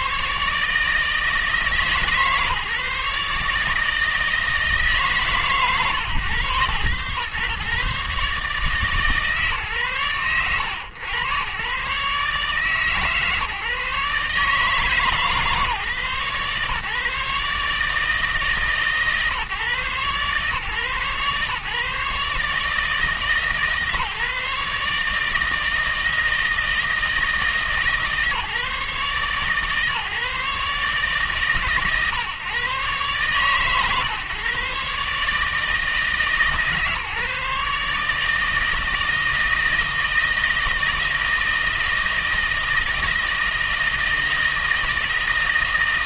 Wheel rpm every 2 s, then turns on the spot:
160, 150, 150, 120, 150, 110, 150, 150, 140, 140, 140, 150, 150, 160, 150, 150, 140, 140, 150, 160, 160, 160, 160.
none